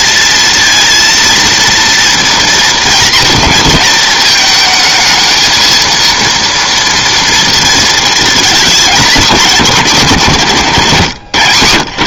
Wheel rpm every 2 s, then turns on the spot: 230, 230, 220, 230, 220, 150.
none